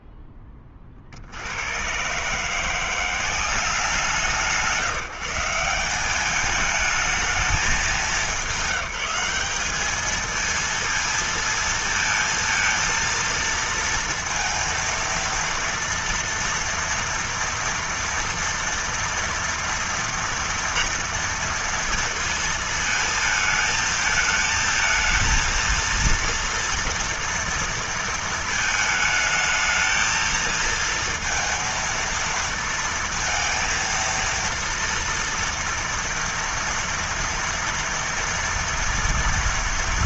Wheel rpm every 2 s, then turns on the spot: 10, 150, 160, 200, 210, 220, 230, 230, 230, 230, 230, 230, 220, 230, 220, 220, 230, 230, 230, 230.
none